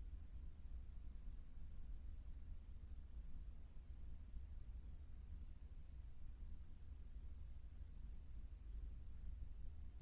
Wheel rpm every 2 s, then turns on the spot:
0, 0, 0, 0, 0.
none